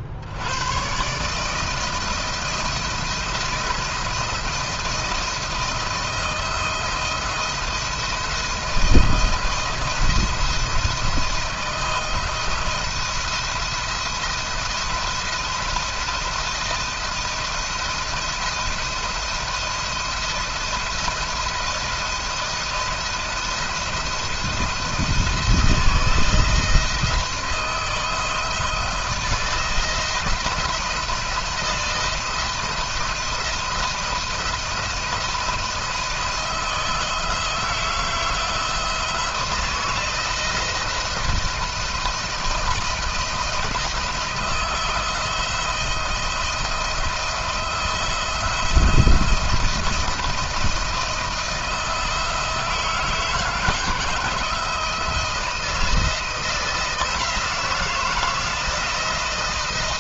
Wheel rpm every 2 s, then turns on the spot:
100, 170, 170, 170, 170, 160, 170, 170, 170, 170, 170, 170, 170, 170, 160, 170, 170, 170, 160, 160, 160, 170, 170, 170, 170, 170, 160, 160, 170, 160.
none